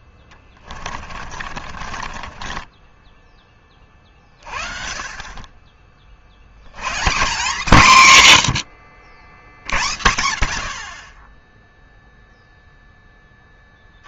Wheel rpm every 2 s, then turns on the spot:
30, 20, 40, 120, 100, 60, 10.
0-4